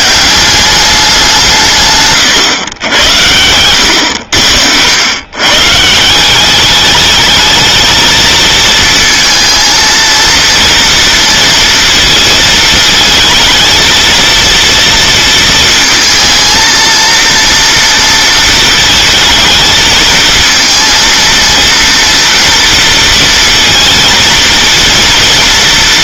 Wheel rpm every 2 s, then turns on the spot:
200, 110, 80, 200, 230, 230, 220, 230, 230, 220, 230, 230, 230.
none